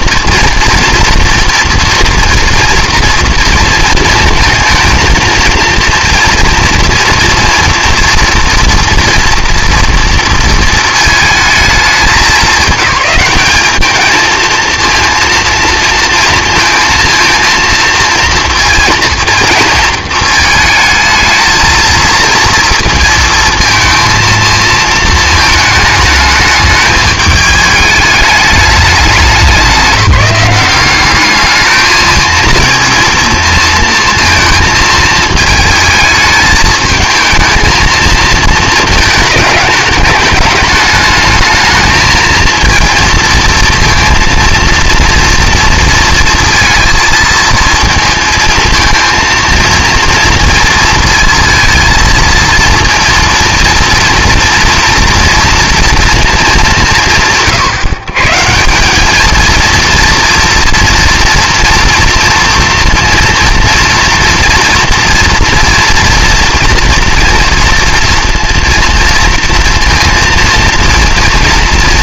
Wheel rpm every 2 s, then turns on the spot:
230, 230, 230, 230, 230, 230, 200, 230, 230, 230, 220, 230, 220, 210, 210, 190, 230, 230, 220, 230, 210, 230, 230, 230, 230, 230, 230, 240, 200, 180, 240, 230, 230, 230, 230, 230.
none